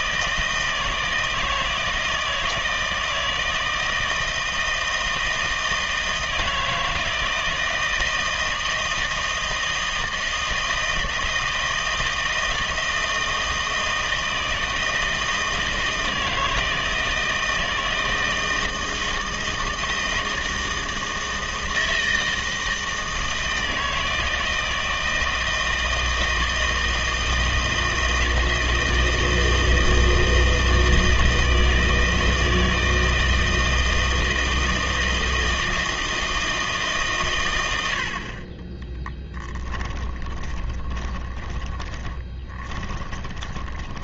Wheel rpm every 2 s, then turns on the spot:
160, 160, 160, 160, 160, 160, 160, 160, 160, 160, 160, 160, 160, 160, 160, 160, 160, 160, 160, 30, 20, 30.
40-44